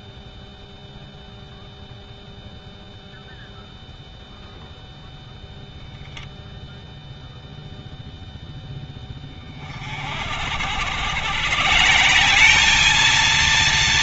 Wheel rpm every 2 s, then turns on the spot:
0, 0, 0, 10, 80, 210, 230.
none